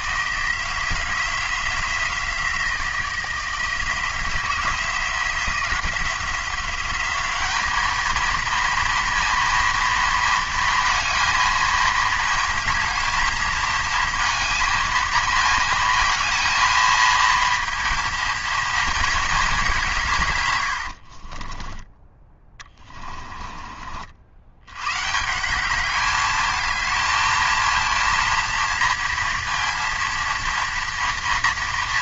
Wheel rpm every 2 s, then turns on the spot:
170, 170, 170, 190, 230, 230, 220, 220, 220, 230, 90, 20, 110, 220, 230, 230.
20-24